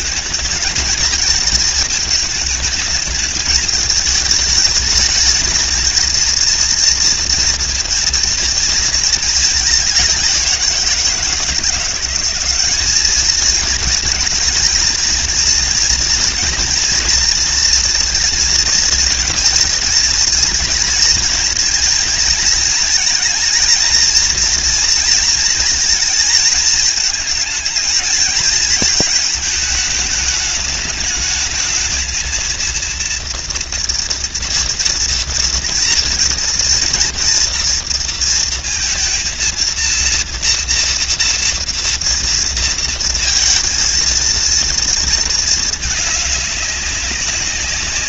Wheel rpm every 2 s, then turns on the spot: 220, 220, 220, 230, 220, 170, 210, 230, 240, 230, 220, 230, 230, 220, 220, 210, 230, 230, 240, 230, 230, 230, 230, 200.
none